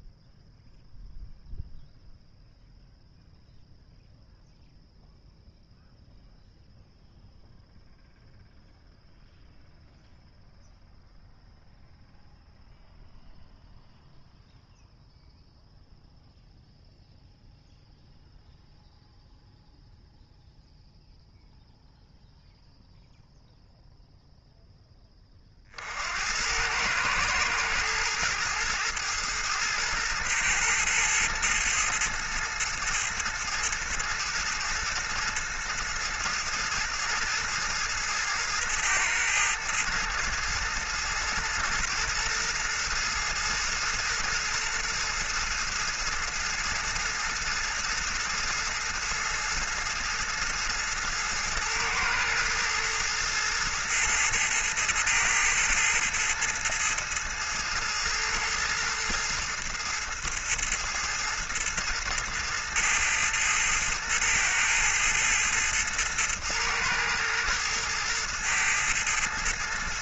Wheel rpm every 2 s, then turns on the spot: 0, 0, 0, 0, 0, 0, 0, 0, 0, 0, 0, 0, 10, 100, 110, 120, 110, 110, 110, 110, 110, 110, 110, 110, 110, 110, 110, 110, 110, 110, 110, 110, 110, 110, 110.
none